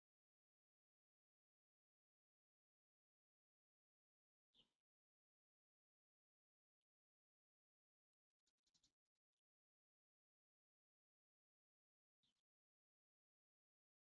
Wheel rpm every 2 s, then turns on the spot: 0, 0, 0, 0, 0, 0, 0.
none